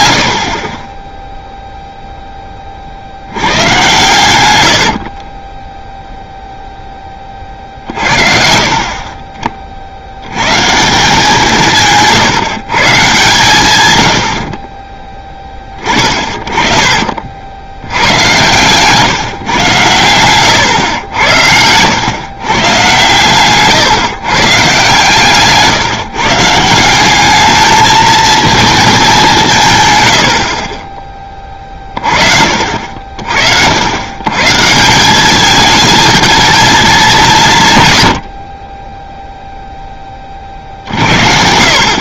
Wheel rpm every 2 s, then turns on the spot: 20, 40, 80, 0, 50, 150, 130, 40, 30, 130, 110, 120, 140, 170, 220, 40, 50, 160, 220, 20, 60.
4-6 16-22